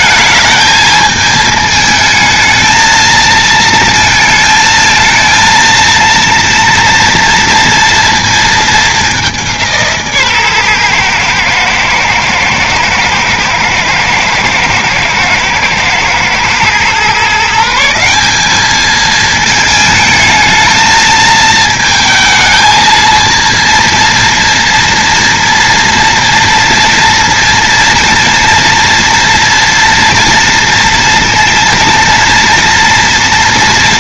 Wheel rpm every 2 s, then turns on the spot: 220, 220, 220, 230, 220, 130, 110, 110, 120, 210, 220, 220, 230, 230, 230, 230, 230.
none